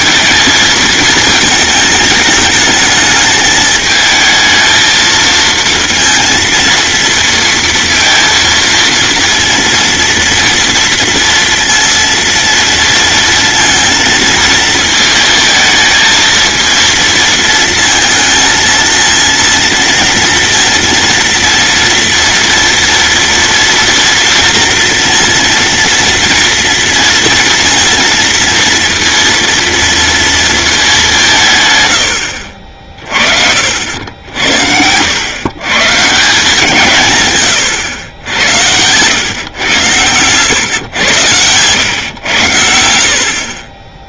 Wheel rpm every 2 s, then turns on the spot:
220, 220, 220, 230, 230, 230, 230, 230, 230, 230, 230, 240, 230, 230, 230, 210, 50, 70, 160, 90, 120, 70.
none